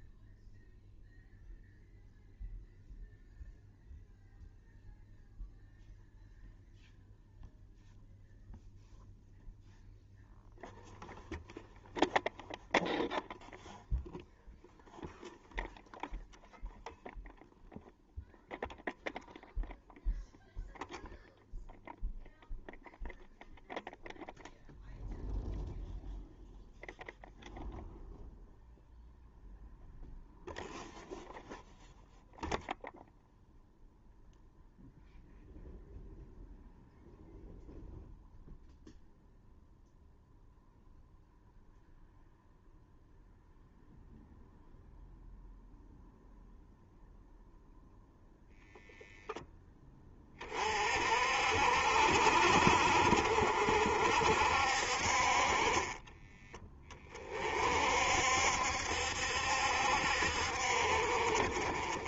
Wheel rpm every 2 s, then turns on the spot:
0, 0, 0, 0, 0, 0, 0, 0, 0, 0, 0, 0, 0, 0, 0, 0, 0, 0, 0, 0, 0, 0, 0, 0, 0, 40, 50, 60, 20, 70, 50.
none